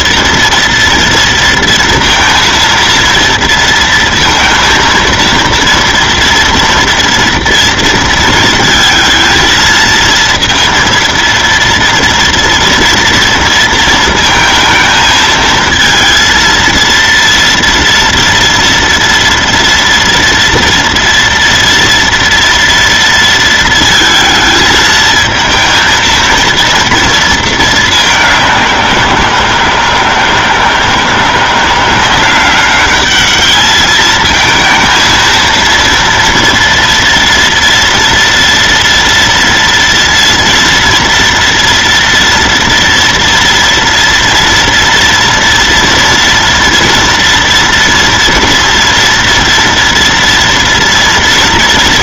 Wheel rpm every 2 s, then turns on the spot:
230, 230, 230, 230, 220, 230, 230, 230, 230, 230, 230, 220, 230, 220, 160, 170, 210, 230, 240, 230, 230, 230, 230, 230, 230, 230.
none